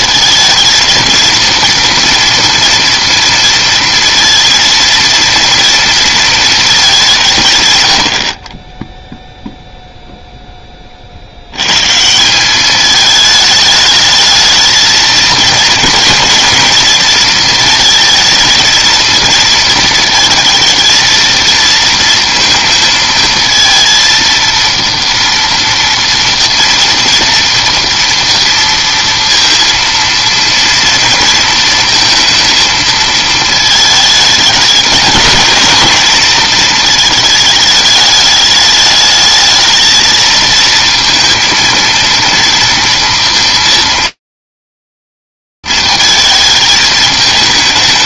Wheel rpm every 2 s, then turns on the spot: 220, 230, 230, 220, 20, 10, 200, 220, 230, 220, 230, 230, 230, 230, 230, 230, 230, 210, 230, 210, 220, 230, 220, 210.
none